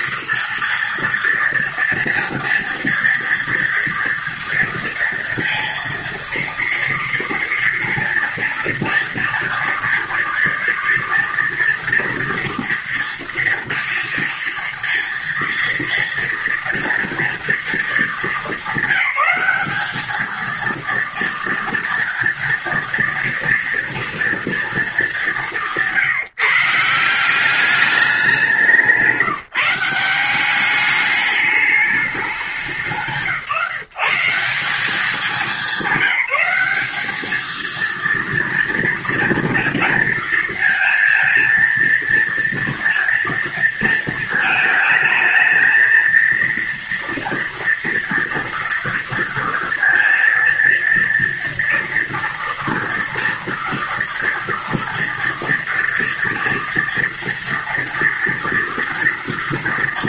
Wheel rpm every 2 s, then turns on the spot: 230, 230, 230, 230, 230, 230, 230, 230, 230, 220, 220, 230, 230, 160, 190, 190, 190, 180, 190, 230, 230, 230, 220, 230, 230, 240, 230, 230, 230, 230.
none